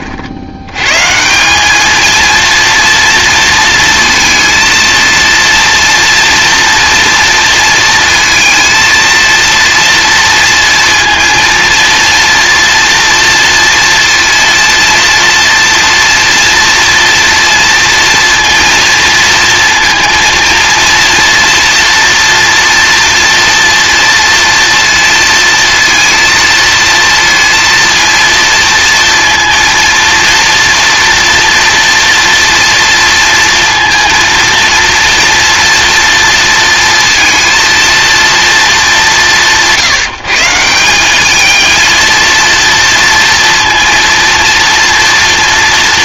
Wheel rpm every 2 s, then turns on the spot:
90, 230, 230, 230, 230, 230, 230, 230, 230, 230, 230, 240, 230, 230, 230, 230, 230, 230, 230, 220, 170, 230, 230.
none